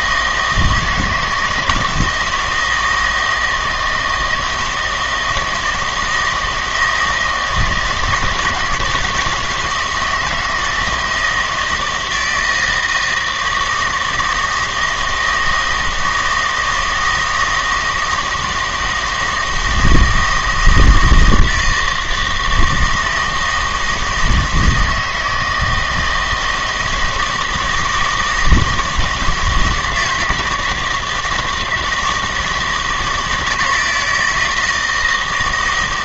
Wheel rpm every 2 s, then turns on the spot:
160, 160, 160, 160, 160, 160, 160, 160, 160, 160, 160, 160, 160, 160, 170, 160, 160, 160.
none